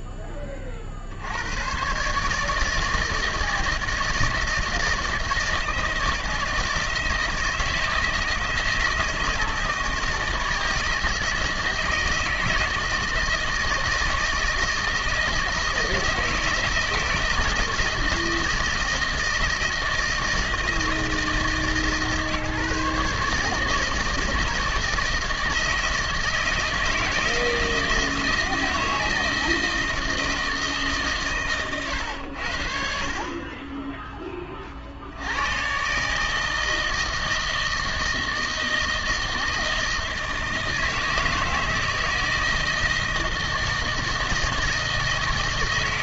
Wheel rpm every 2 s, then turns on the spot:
20, 150, 160, 160, 160, 160, 160, 160, 160, 160, 160, 150, 160, 160, 160, 160, 70, 30, 160, 160, 160, 160, 160.
none